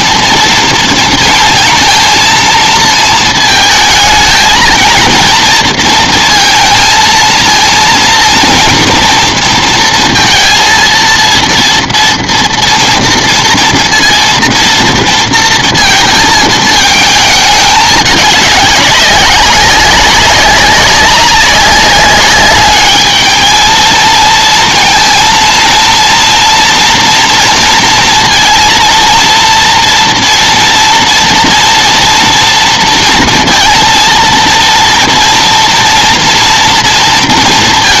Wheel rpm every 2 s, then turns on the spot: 230, 220, 230, 230, 230, 230, 240, 230, 220, 200, 190, 210, 230, 240, 230, 230, 230, 230, 230.
none